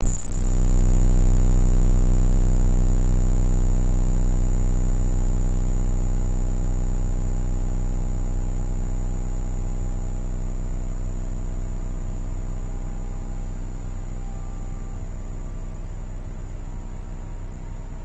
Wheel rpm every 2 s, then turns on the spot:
0, 0, 0, 0, 0, 0, 0, 0, 0.
none